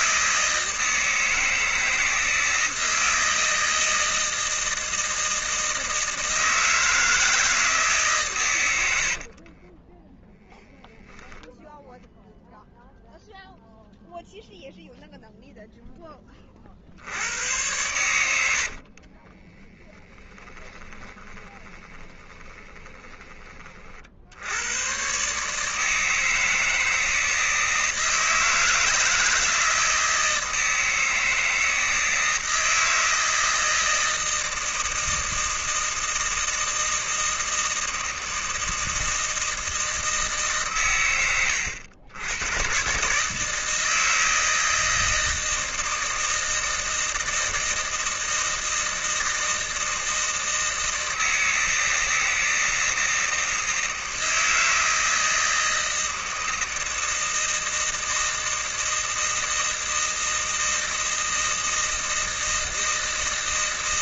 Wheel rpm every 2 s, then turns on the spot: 160, 160, 160, 160, 90, 0, 0, 0, 60, 50, 20, 20, 110, 160, 160, 160, 160, 160, 160, 160, 130, 130, 160, 160, 160, 160, 160, 160, 160, 160, 160, 160.
18-24